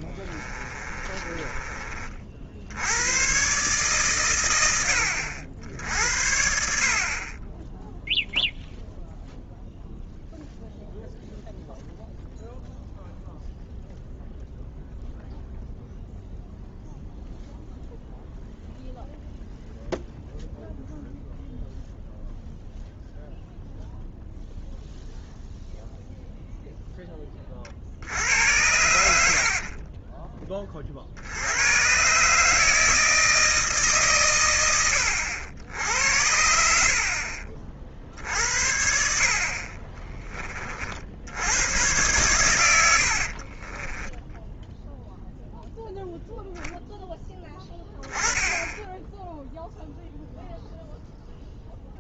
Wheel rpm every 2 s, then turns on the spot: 20, 70, 100, 60, 0, 0, 0, 0, 0, 0, 0, 0, 0, 0, 80, 20, 150, 110, 70, 70, 30, 110, 10, 0, 10, 0.
0-2